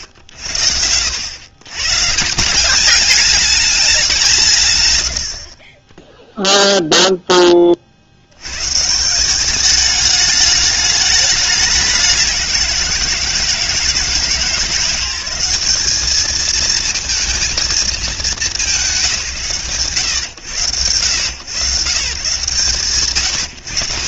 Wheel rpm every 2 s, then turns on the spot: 90, 180, 140, 0, 110, 210, 180, 160, 220, 220, 100, 120.
none